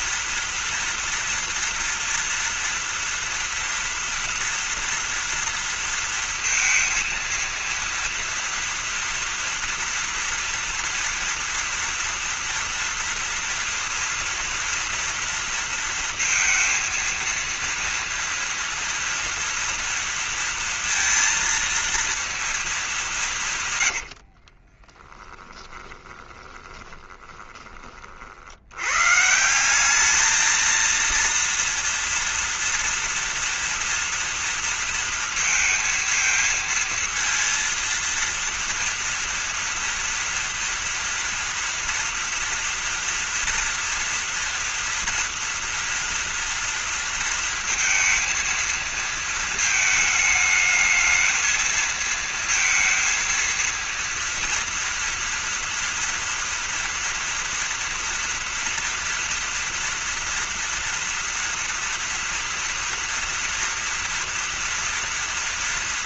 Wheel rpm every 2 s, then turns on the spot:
240, 240, 240, 230, 230, 230, 240, 230, 230, 230, 230, 220, 50, 20, 80, 230, 230, 230, 220, 230, 230, 240, 230, 230, 230, 220, 230, 230, 230, 230, 230, 230, 230.
24-28